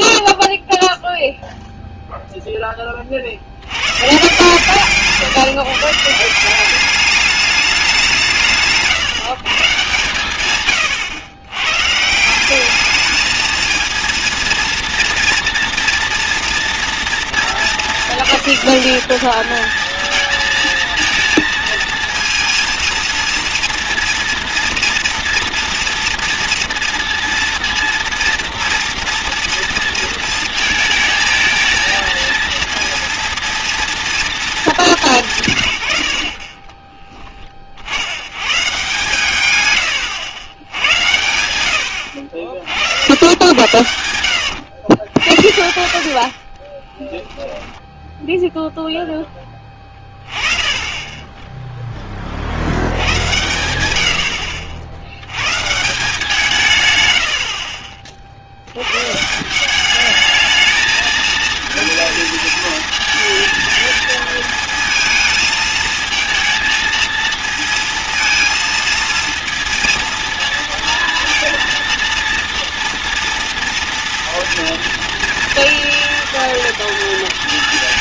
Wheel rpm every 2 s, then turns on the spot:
0, 20, 150, 190, 160, 120, 200, 230, 230, 200, 230, 230, 230, 230, 230, 220, 230, 210, 40, 130, 90, 60, 90, 30, 0, 20, 70, 70, 140, 110, 220, 220, 220, 230, 230, 230, 230, 230, 230.
none